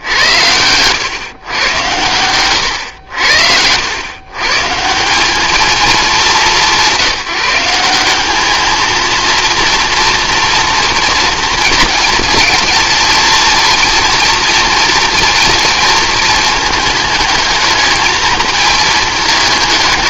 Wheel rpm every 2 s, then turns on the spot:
110, 110, 150, 190, 220, 240, 230, 230, 220, 220.
2-4